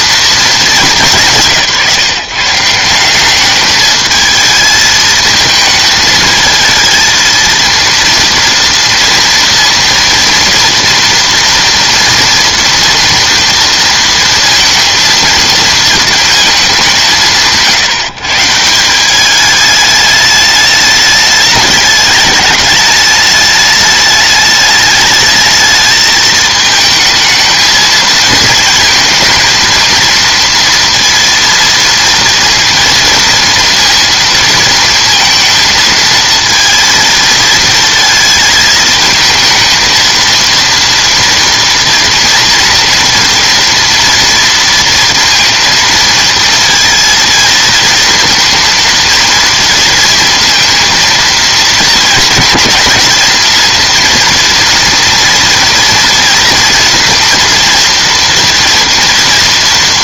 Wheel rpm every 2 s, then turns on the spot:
160, 210, 220, 230, 230, 230, 230, 230, 150, 210, 210, 210, 220, 230, 230, 230, 230, 230, 230, 230, 230, 230, 230, 230, 230, 230, 230, 230, 230, 230.
none